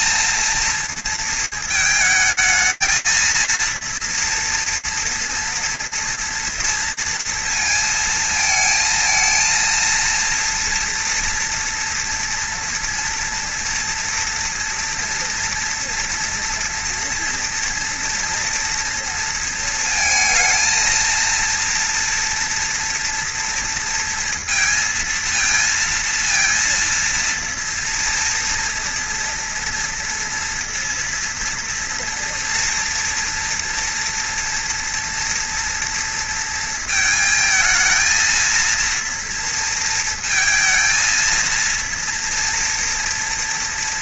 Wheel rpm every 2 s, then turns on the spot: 230, 230, 240, 230, 220, 230, 240, 230, 240, 230, 230, 230, 230, 230, 230, 230, 230, 230, 220, 230, 230, 230.
none